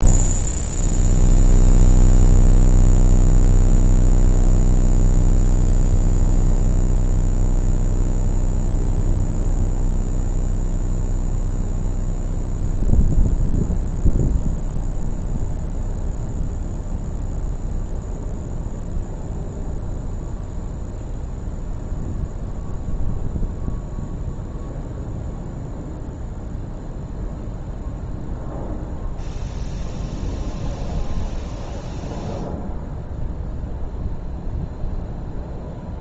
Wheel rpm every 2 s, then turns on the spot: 0, 0, 0, 0, 0, 0, 0, 0, 0, 0, 0, 0, 0, 0, 0, 0, 0, 0.
none